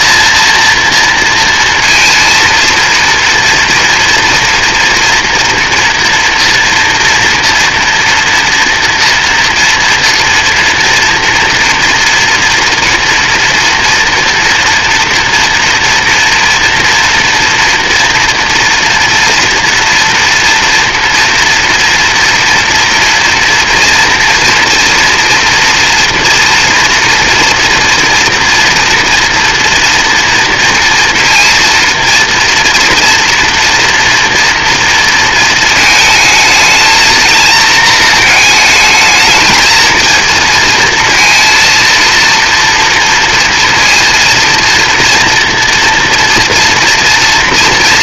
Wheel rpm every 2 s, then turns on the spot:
230, 230, 230, 230, 230, 240, 230, 230, 230, 230, 230, 230, 230, 240, 230, 230, 230, 230, 220, 220, 230, 230, 230, 230.
none